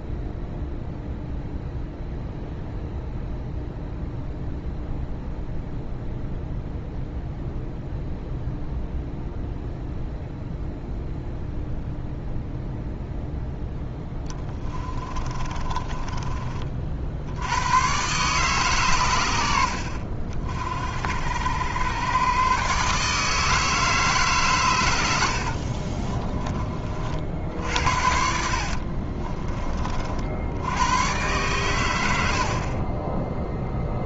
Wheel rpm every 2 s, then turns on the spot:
0, 0, 0, 0, 0, 0, 0, 30, 40, 120, 60, 140, 110, 30, 50, 90, 30.
14-16 28-30 32-34